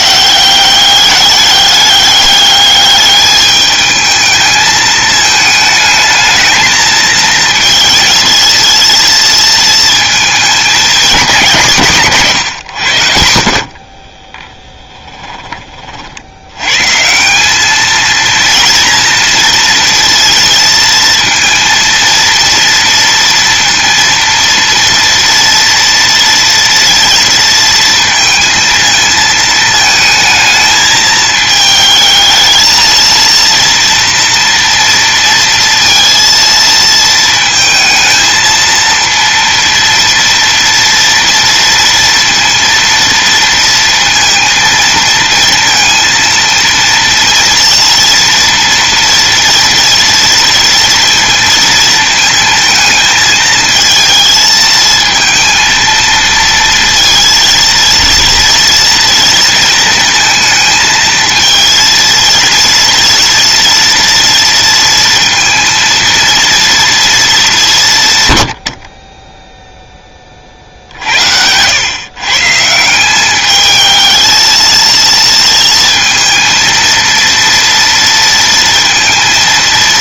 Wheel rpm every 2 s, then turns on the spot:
200, 210, 220, 220, 230, 210, 90, 10, 150, 230, 230, 230, 230, 230, 230, 220, 230, 230, 230, 230, 230, 230, 230, 230, 230, 230, 220, 230, 230, 230, 220, 230, 230, 230, 50, 60, 180, 230, 230, 220.
none